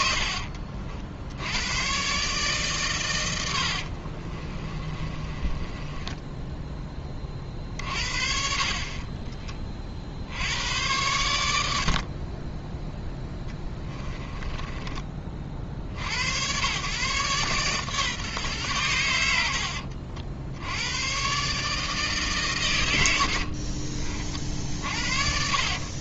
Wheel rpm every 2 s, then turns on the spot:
60, 130, 30, 10, 40, 100, 10, 20, 120, 120, 90, 100, 50.
4-6 14-16